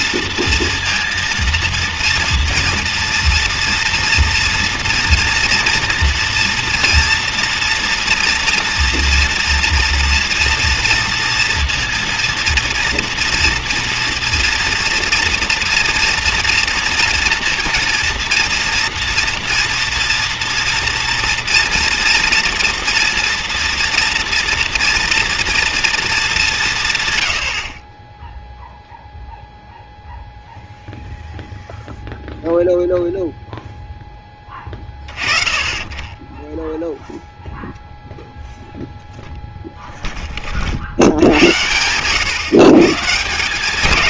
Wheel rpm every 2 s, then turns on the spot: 230, 230, 240, 230, 230, 230, 230, 230, 240, 240, 230, 230, 230, 120, 0, 0, 0, 30, 0, 0, 70, 140.
none